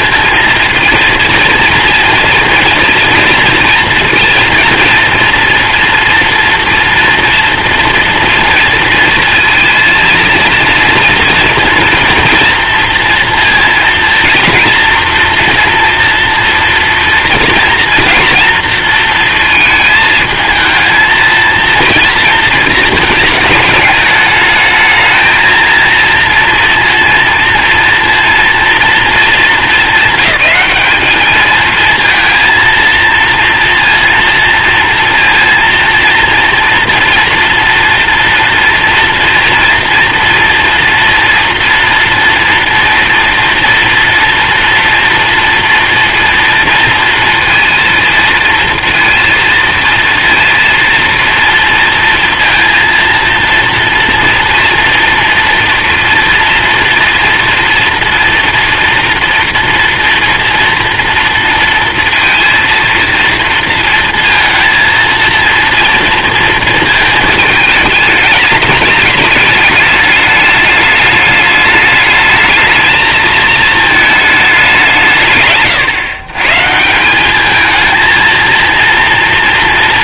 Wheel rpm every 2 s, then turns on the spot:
230, 230, 230, 230, 230, 230, 230, 240, 230, 230, 220, 220, 220, 230, 230, 210, 230, 230, 230, 230, 230, 240, 230, 230, 230, 230, 230, 230, 230, 230, 230, 230, 230, 220, 210, 210, 220, 170, 180, 230.
none